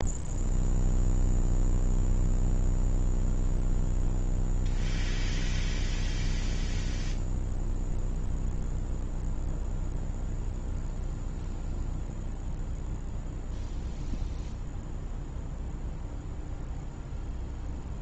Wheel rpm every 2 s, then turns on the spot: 0, 0, 0, 0, 0, 0, 0, 0, 0.
none